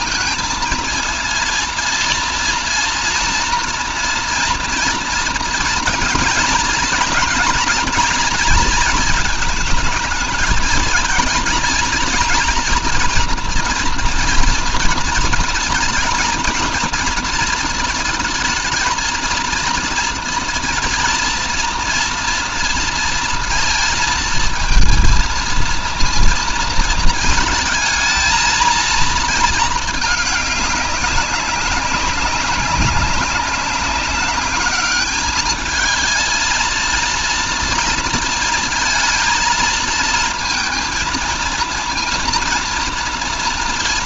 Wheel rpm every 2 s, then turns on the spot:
230, 230, 230, 240, 220, 220, 240, 230, 230, 220, 230, 230, 230, 230, 230, 200, 190, 210, 230, 230, 230, 230.
none